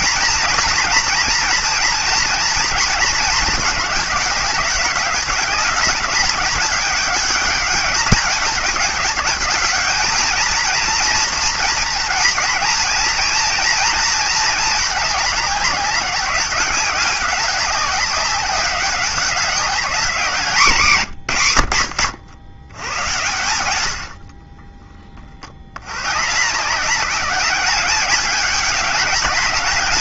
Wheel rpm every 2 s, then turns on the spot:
230, 230, 200, 210, 210, 230, 230, 220, 190, 200, 170, 100, 40, 170, 210.
24-26